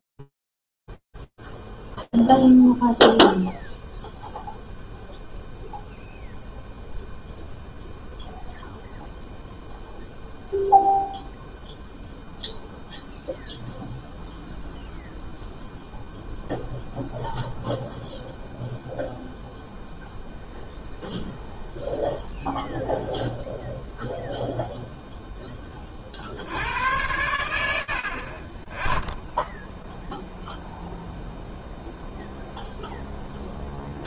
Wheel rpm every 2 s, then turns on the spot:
0, 0, 0, 0, 0, 0, 0, 0, 0, 0, 0, 0, 100, 20, 0, 0, 0.
none